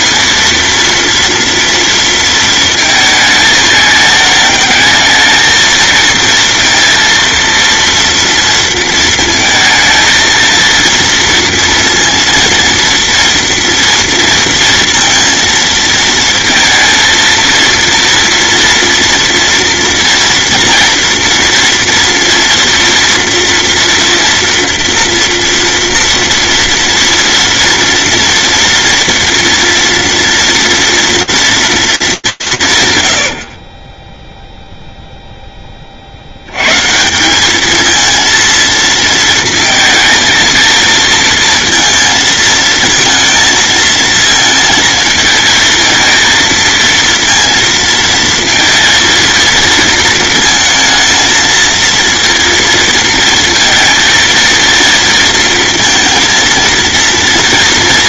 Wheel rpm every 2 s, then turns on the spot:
230, 220, 220, 230, 230, 230, 230, 230, 230, 230, 230, 230, 230, 230, 230, 230, 120, 0, 160, 230, 230, 230, 230, 230, 230, 230, 230, 230, 230.
none